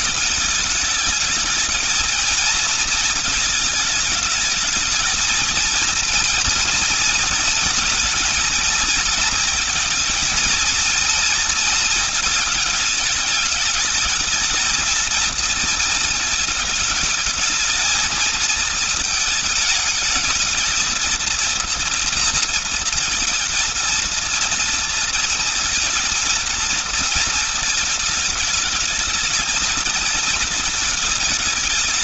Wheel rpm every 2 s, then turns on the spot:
210, 220, 220, 230, 230, 230, 220, 230, 220, 220, 220, 230, 230, 230, 220, 220.
none